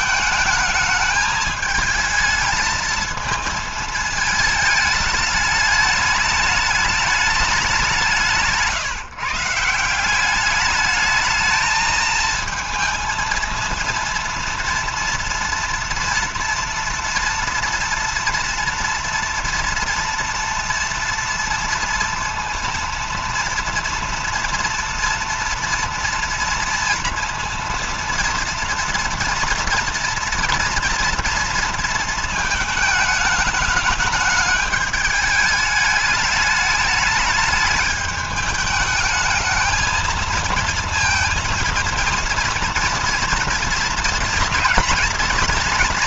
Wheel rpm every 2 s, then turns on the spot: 220, 220, 210, 210, 160, 200, 220, 230, 230, 240, 230, 230, 230, 230, 230, 240, 220, 210, 210, 210, 230, 230, 230.
none